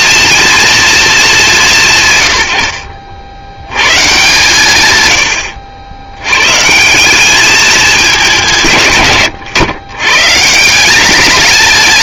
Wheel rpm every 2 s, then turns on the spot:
220, 70, 110, 170, 110, 200.
none